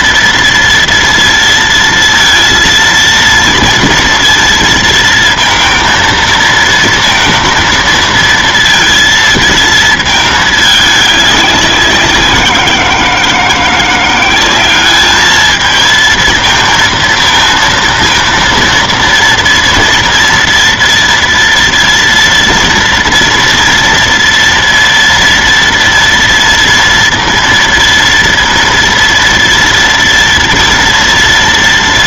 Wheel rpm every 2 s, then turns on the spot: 230, 230, 230, 230, 230, 210, 180, 200, 230, 230, 230, 230, 230, 230, 230, 230.
none